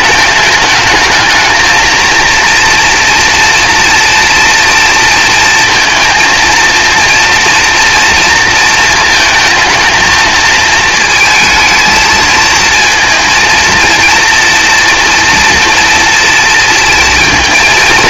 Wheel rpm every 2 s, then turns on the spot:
220, 240, 230, 230, 230, 220, 230, 230, 230.
none